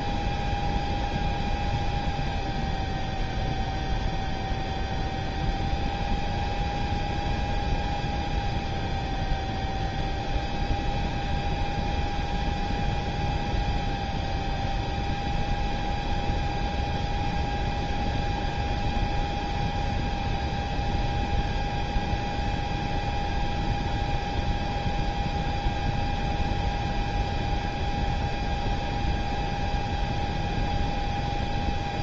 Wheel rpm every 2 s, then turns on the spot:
0, 0, 0, 0, 0, 0, 0, 0, 0, 0, 0, 0, 0, 0, 0, 0.
none